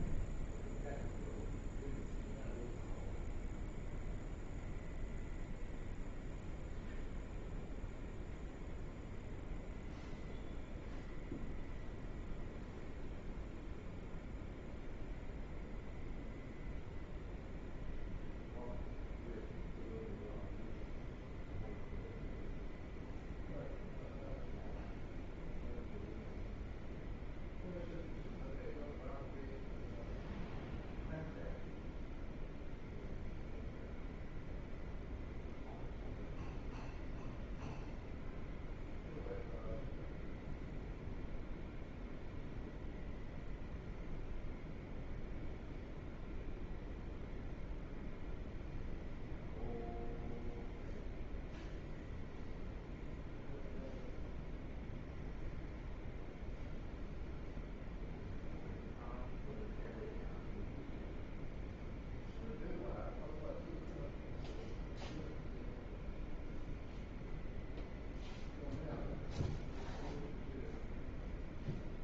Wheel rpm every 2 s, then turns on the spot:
0, 0, 0, 0, 0, 0, 0, 0, 0, 0, 0, 0, 0, 0, 0, 0, 0, 0, 0, 0, 0, 0, 0, 0, 0, 0, 0, 0, 0, 0, 0, 0, 0, 0, 0, 0.
none